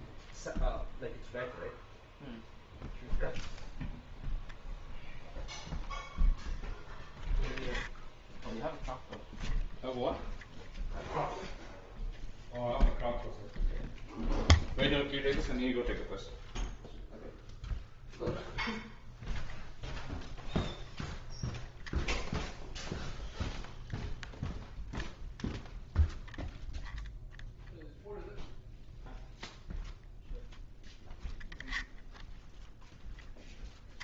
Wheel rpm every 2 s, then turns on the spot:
0, 0, 0, 0, 0, 0, 0, 0, 0, 0, 0, 0, 0, 0, 0, 0, 0.
none